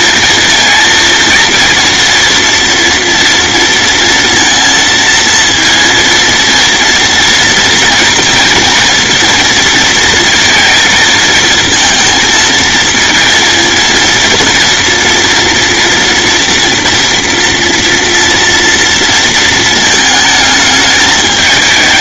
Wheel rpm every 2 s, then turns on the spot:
230, 230, 230, 230, 230, 220, 230, 230, 230, 230, 210.
none